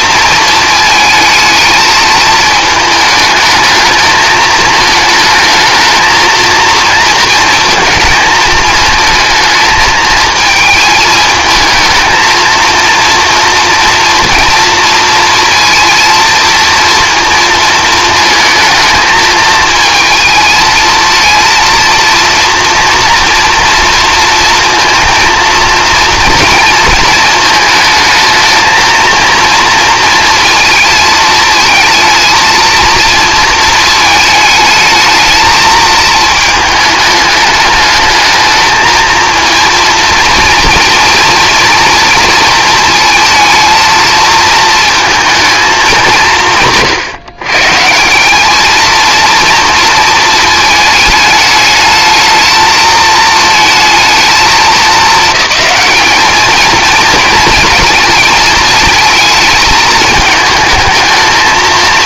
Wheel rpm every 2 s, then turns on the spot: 220, 220, 220, 220, 220, 220, 230, 230, 230, 220, 220, 230, 230, 230, 220, 230, 230, 220, 220, 220, 230, 230, 220, 110, 220, 220, 220, 210, 220, 220, 220.
none